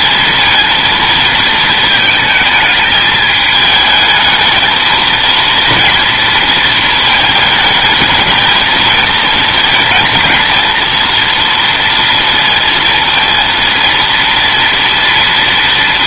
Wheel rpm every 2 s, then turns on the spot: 230, 220, 230, 230, 220, 220, 230, 230.
none